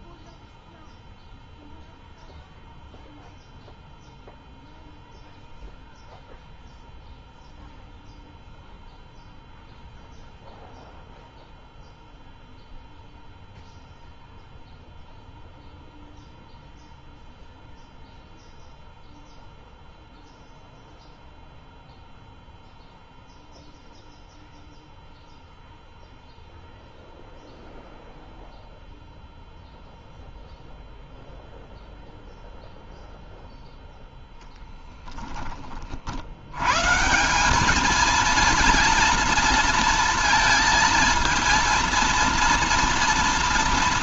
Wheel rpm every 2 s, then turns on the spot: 0, 0, 0, 0, 0, 0, 0, 0, 0, 0, 0, 0, 0, 0, 0, 0, 0, 0, 90, 230, 230, 230.
none